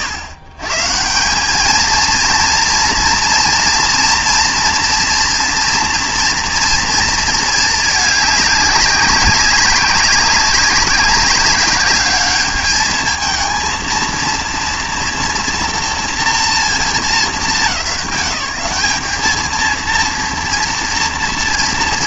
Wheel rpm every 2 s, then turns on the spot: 110, 230, 230, 230, 200, 200, 210, 230, 230, 190, 230.
none